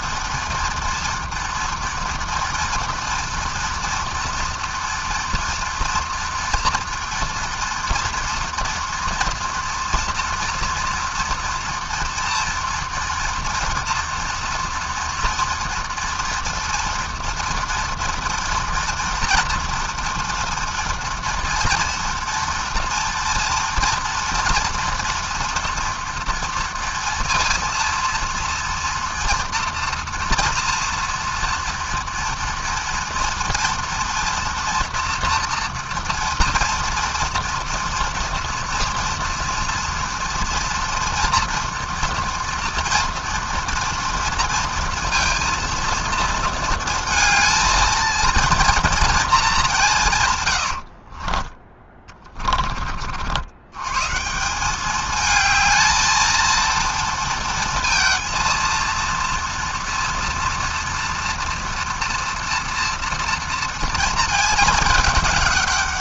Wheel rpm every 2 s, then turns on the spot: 230, 230, 230, 230, 230, 230, 230, 230, 240, 230, 230, 230, 230, 230, 230, 230, 230, 230, 230, 230, 240, 230, 230, 230, 210, 40, 60, 210, 230, 230, 230, 230, 210.
50-52